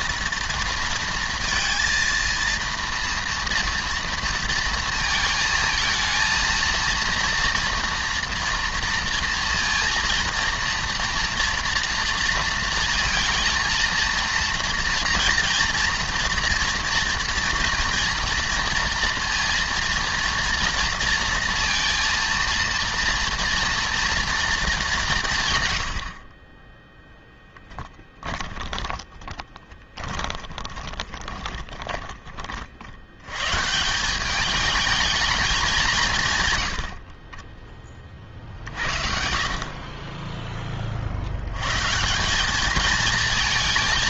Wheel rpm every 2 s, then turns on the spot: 230, 230, 230, 230, 230, 230, 230, 230, 230, 230, 230, 230, 200, 10, 20, 20, 80, 210, 60, 50, 50, 220.
26-32